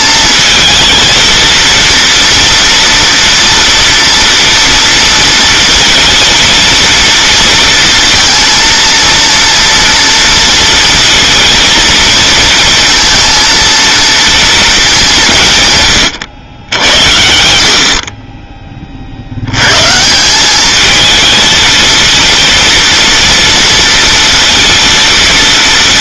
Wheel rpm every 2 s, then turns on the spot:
220, 230, 230, 230, 230, 230, 230, 220, 80, 20, 200, 230, 230.
none